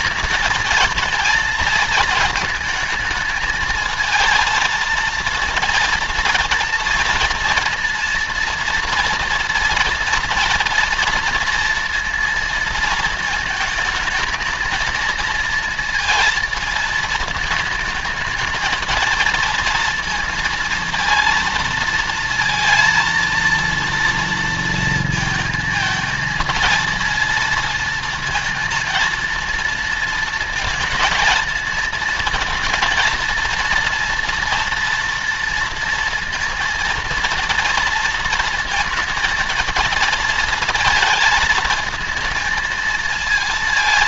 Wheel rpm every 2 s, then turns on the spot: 220, 220, 230, 230, 240, 230, 230, 220, 220, 220, 230, 230, 230, 220, 230, 230, 230, 230, 230, 230, 230, 230.
none